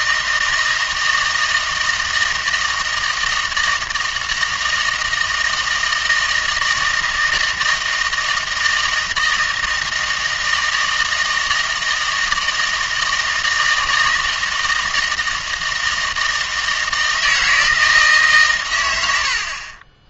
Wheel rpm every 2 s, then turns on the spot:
160, 160, 160, 160, 160, 160, 160, 160, 160, 120.
none